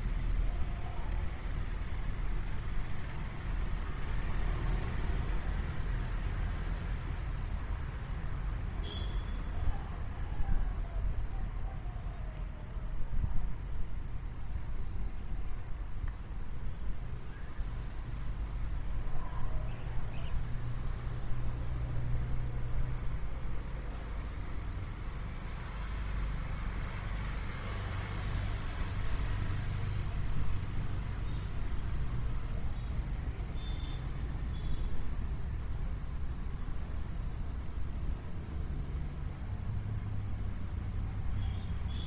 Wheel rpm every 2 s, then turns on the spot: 0, 0, 0, 0, 0, 0, 0, 0, 0, 0, 0, 0, 0, 0, 0, 0, 0, 0, 0, 0, 0.
none